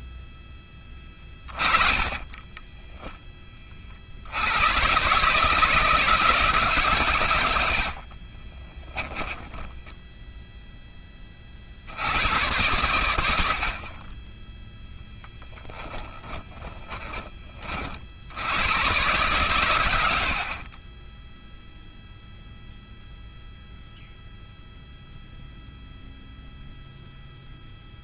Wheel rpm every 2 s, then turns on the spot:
20, 10, 130, 130, 10, 20, 100, 10, 10, 120, 20, 0, 0, 0.
0-2 8-10